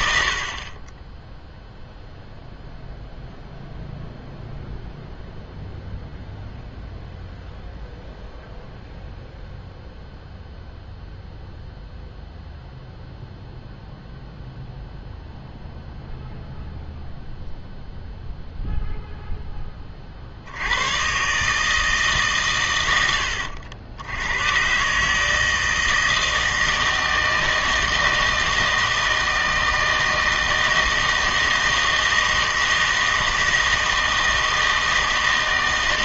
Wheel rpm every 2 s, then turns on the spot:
30, 0, 0, 0, 0, 0, 0, 0, 0, 0, 90, 120, 130, 160, 160, 160, 160, 160.
none